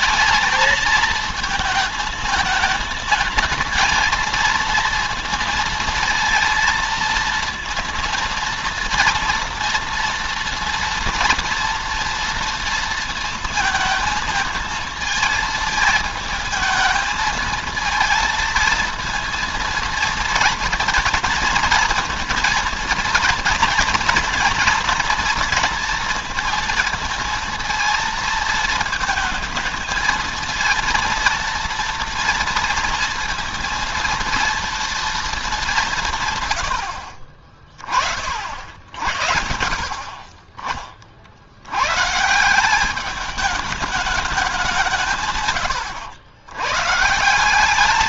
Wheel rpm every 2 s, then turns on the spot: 220, 220, 230, 230, 230, 240, 230, 220, 220, 230, 220, 230, 230, 230, 230, 230, 230, 230, 70, 60, 30, 190, 180, 130.
none